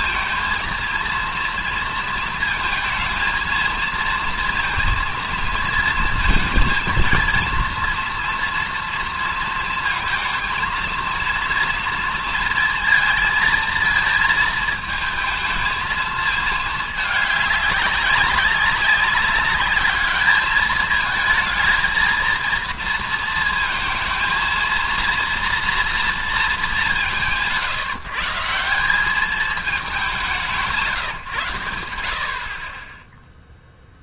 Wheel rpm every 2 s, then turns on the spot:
230, 220, 230, 230, 230, 230, 230, 220, 220, 200, 210, 220, 230, 200, 170, 170, 30.
none